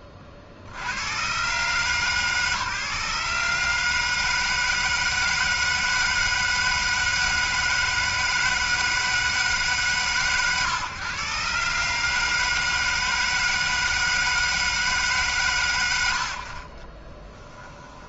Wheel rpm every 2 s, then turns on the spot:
80, 140, 160, 160, 160, 130, 160, 140, 30.
16-18